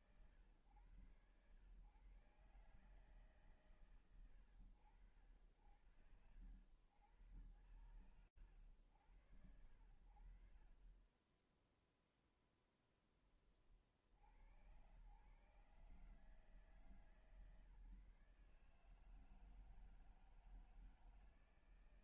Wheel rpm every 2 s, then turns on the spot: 110, 90, 80, 90, 80, 0, 30, 140, 150, 160, 150.
none